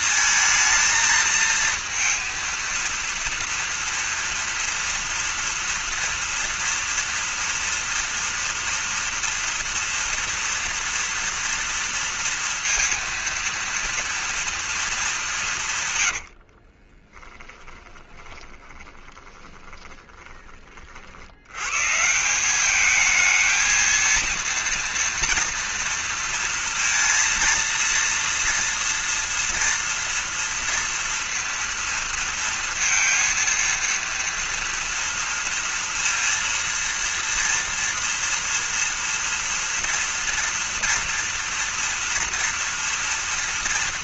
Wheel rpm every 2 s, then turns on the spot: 220, 230, 240, 230, 230, 230, 230, 230, 40, 10, 50, 210, 230, 230, 230, 230, 230, 230, 230, 240, 230, 230.
16-20